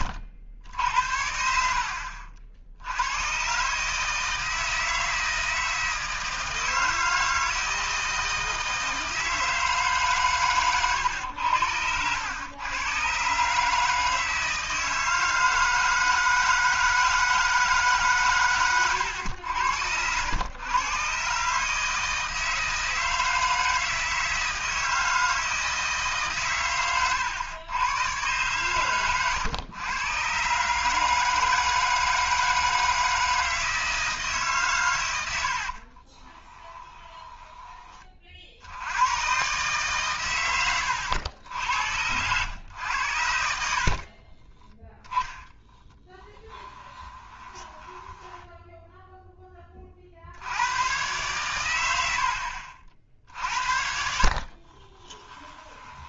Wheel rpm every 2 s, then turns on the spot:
70, 70, 160, 160, 160, 110, 110, 160, 160, 120, 110, 160, 160, 120, 120, 140, 160, 130, 20, 50, 100, 100, 40, 10, 10, 100, 60, 40.
36-38 44-50 54-56